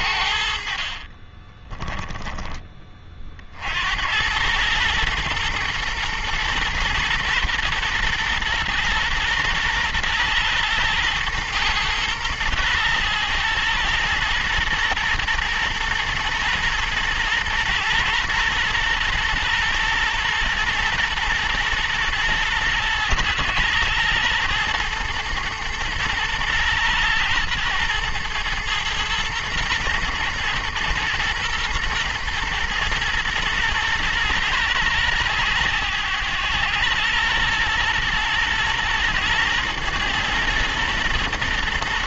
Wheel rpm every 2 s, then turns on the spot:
50, 20, 110, 120, 120, 110, 110, 120, 120, 120, 120, 110, 120, 110, 110, 120, 120, 110, 110, 110, 110.
0-2